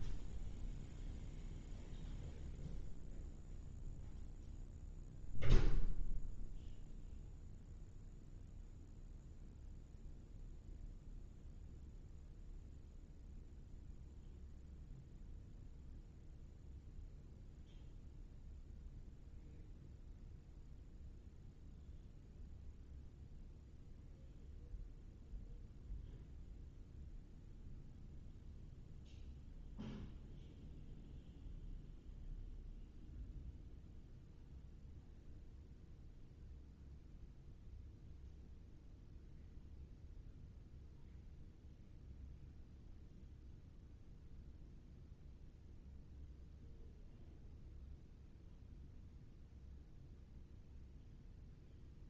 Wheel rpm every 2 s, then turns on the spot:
0, 0, 0, 0, 0, 0, 0, 0, 0, 0, 0, 0, 0, 0, 0, 0, 0, 0, 0, 0, 0, 0, 0, 0, 0, 0.
none